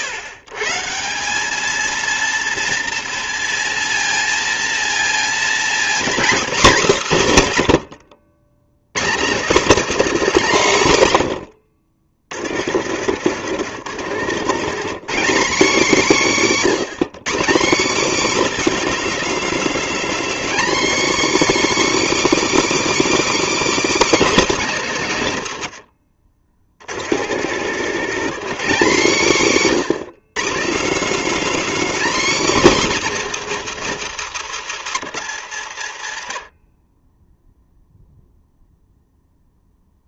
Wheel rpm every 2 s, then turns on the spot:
140, 230, 230, 250, 140, 200, 80, 160, 190, 290, 270, 330, 240, 70, 200, 190, 280, 160, 30, 0.
12-14 26-28